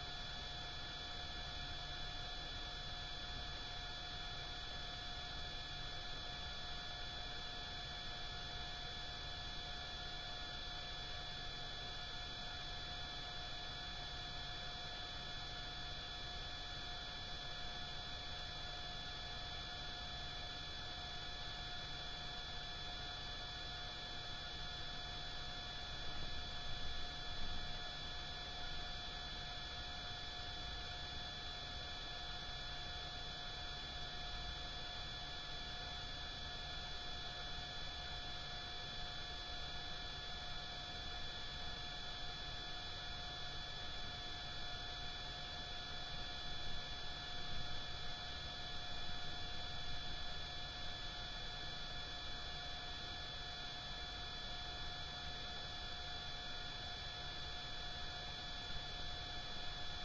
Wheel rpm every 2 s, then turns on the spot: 0, 0, 0, 0, 0, 0, 0, 0, 0, 0, 0, 0, 0, 0, 0, 0, 0, 0, 0, 0, 0, 0, 0, 0, 0, 0, 0, 0, 0, 0.
none